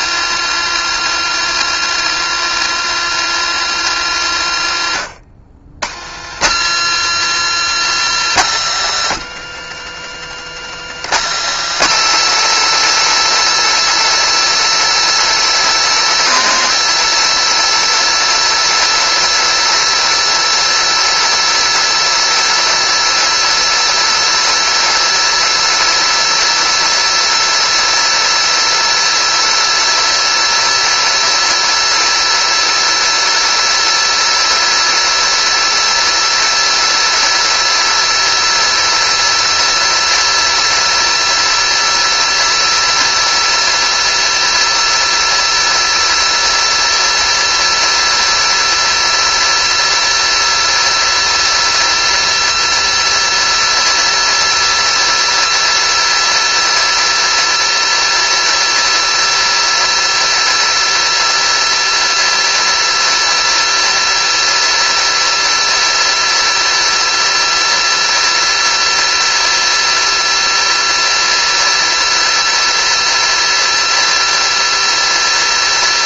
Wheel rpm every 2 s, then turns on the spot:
360, 360, 270, 290, 330, 340, 340, 350, 340, 350, 350, 350, 350, 350, 350, 350, 350, 350, 350, 350, 360, 350, 350, 360, 350, 350, 360, 360, 360, 360, 350, 350, 350, 350, 350, 360, 360, 350.
none